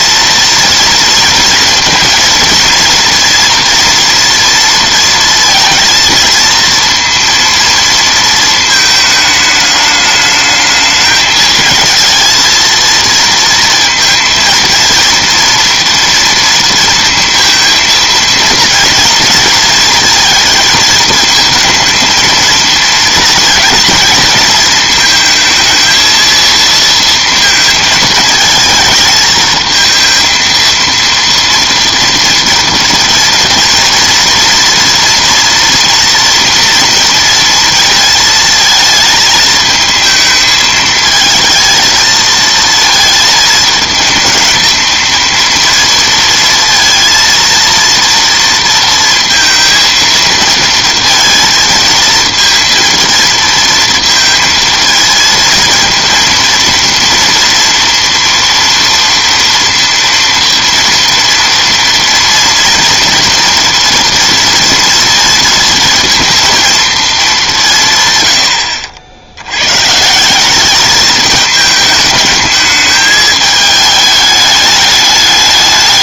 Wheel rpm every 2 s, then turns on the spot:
230, 230, 230, 230, 220, 210, 230, 230, 230, 230, 220, 220, 220, 230, 220, 230, 230, 230, 230, 220, 220, 230, 220, 230, 230, 230, 230, 220, 230, 230, 230, 230, 230, 230, 80, 200, 220, 210.
none